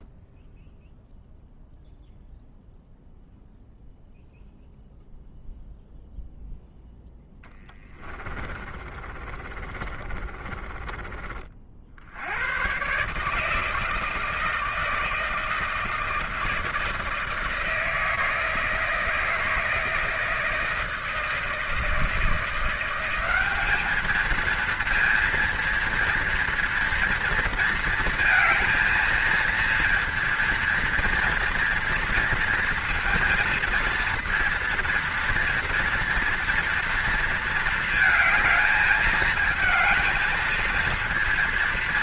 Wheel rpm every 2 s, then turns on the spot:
0, 0, 0, 0, 20, 20, 120, 160, 160, 160, 160, 170, 230, 230, 220, 230, 230, 230, 230, 210, 230.
8-12